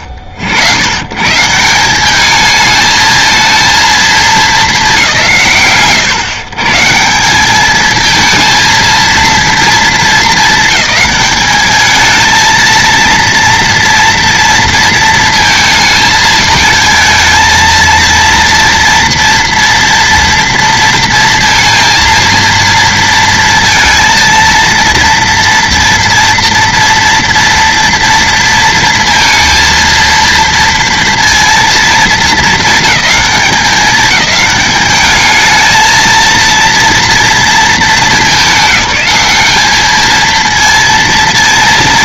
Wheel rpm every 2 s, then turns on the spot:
80, 220, 230, 120, 220, 220, 220, 230, 220, 230, 230, 230, 230, 240, 230, 230, 220, 200, 230, 190, 230.
none